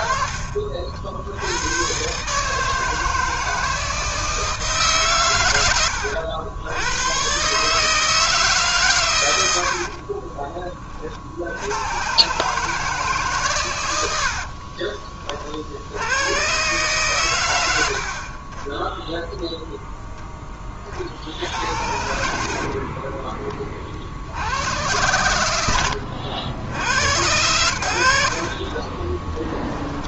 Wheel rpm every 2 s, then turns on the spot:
60, 160, 140, 110, 120, 40, 140, 30, 120, 10, 60, 10, 90, 80, 20.
28-30